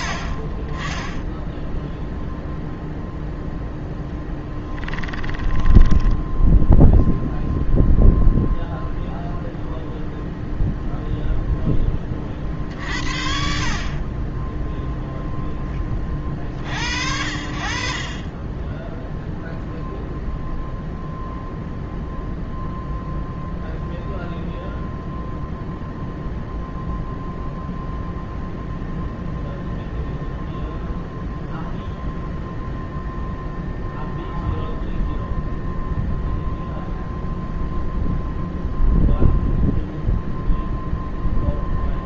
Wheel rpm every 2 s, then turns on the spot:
10, 0, 10, 0, 0, 0, 40, 0, 60, 10, 0, 0, 0, 0, 0, 0, 0, 0, 0, 0, 0.
4-6